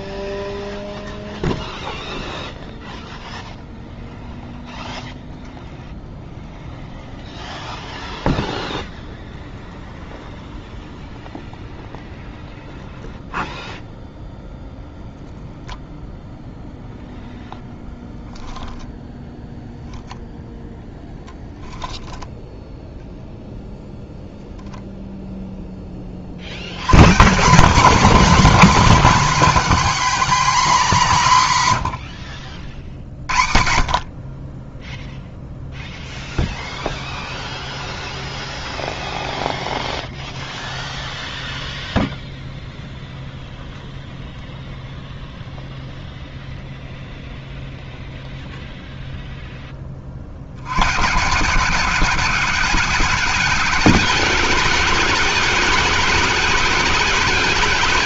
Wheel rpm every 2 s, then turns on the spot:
0, 0, 0, 0, 0, 0, 0, 0, 0, 0, 0, 10, 0, 80, 250, 250, 70, 30, 0, 0, 0, 0, 0, 0, 0, 80, 190, 210, 210.
none